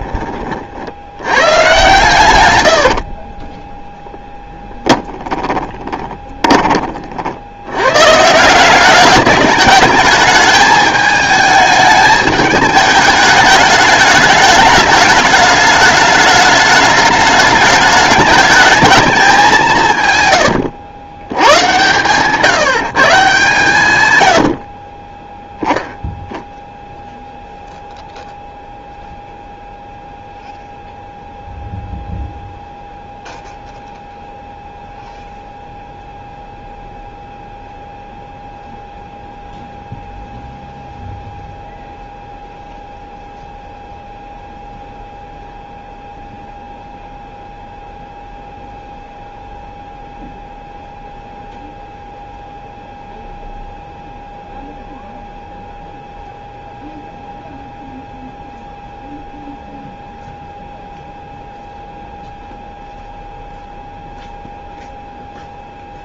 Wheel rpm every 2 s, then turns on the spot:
50, 100, 20, 20, 180, 210, 210, 210, 210, 220, 100, 160, 30, 0, 0, 0, 0, 0, 0, 0, 0, 0, 0, 0, 0, 0, 0, 0, 0, 0, 0, 0, 0.
2-6 20-22